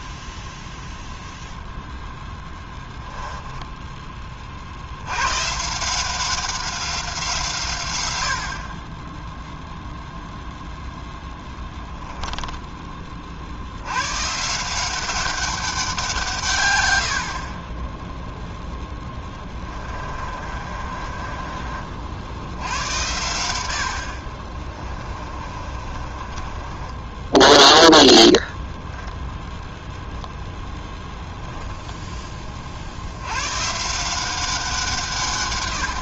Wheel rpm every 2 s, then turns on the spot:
0, 10, 60, 190, 30, 0, 10, 170, 110, 10, 30, 90, 30, 20, 10, 0, 50, 180.
2-4 18-22 24-30